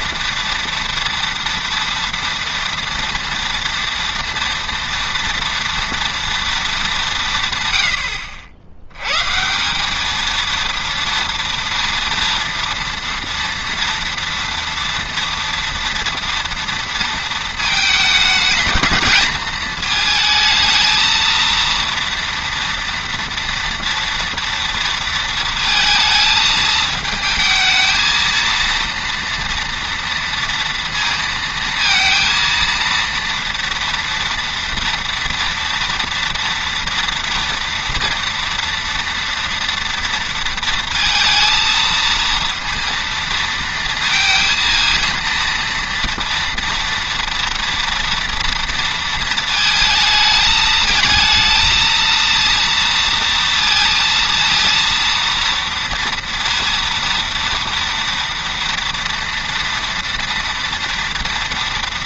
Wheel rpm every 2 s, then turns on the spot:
230, 230, 230, 220, 80, 230, 230, 240, 230, 220, 220, 230, 230, 220, 230, 230, 230, 230, 230, 230, 230, 230, 230, 230, 230, 220, 230, 230, 230, 230, 230.
none